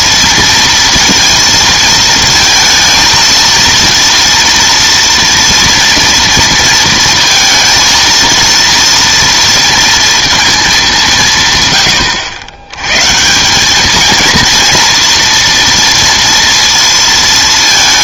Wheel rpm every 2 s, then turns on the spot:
230, 230, 230, 230, 230, 210, 110, 230, 230.
none